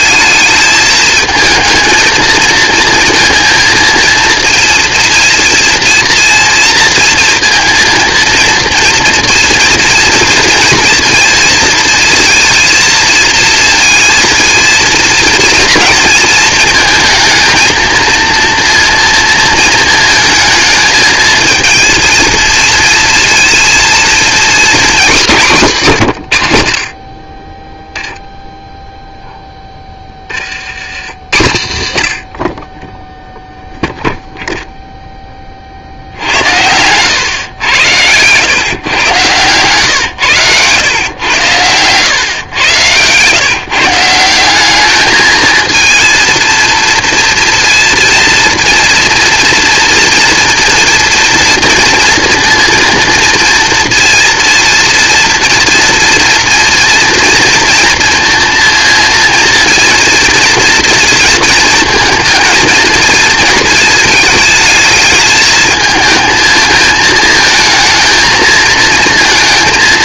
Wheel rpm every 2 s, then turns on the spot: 220, 230, 230, 230, 230, 230, 230, 230, 220, 230, 220, 230, 240, 70, 0, 60, 20, 0, 90, 130, 100, 110, 200, 230, 230, 240, 230, 230, 230, 230, 230, 230, 220, 220, 220.
none